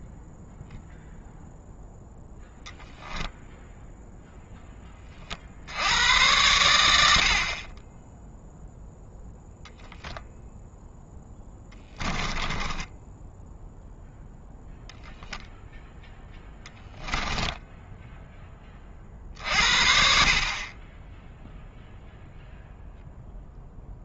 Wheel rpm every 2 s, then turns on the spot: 0, 0, 20, 90, 0, 0, 10, 0, 10, 40, 20, 0.
12-14